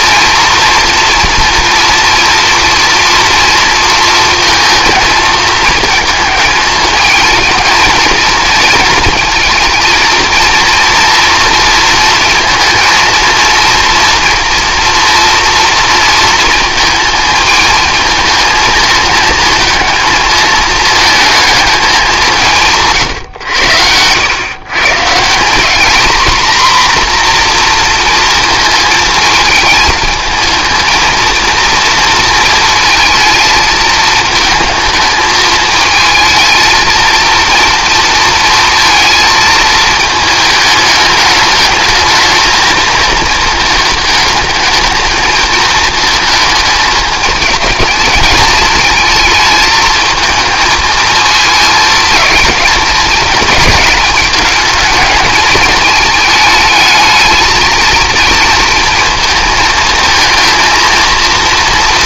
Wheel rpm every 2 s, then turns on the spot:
240, 230, 230, 220, 230, 230, 230, 230, 230, 220, 220, 150, 140, 250, 220, 220, 230, 220, 230, 230, 220, 220, 220, 220, 220, 220, 220, 210, 220, 230, 230.
none